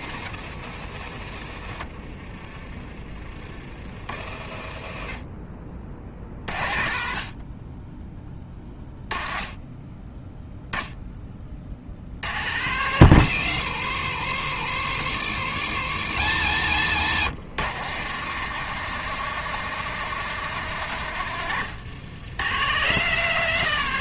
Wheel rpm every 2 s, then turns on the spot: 80, 30, 40, 50, 20, 10, 110, 70, 110, 160, 130, 140.
none